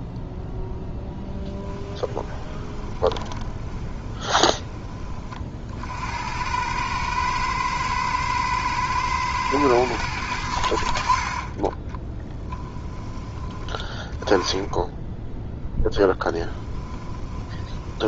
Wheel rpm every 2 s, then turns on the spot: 0, 20, 30, 100, 110, 60, 20, 10, 20.
2-4 16-18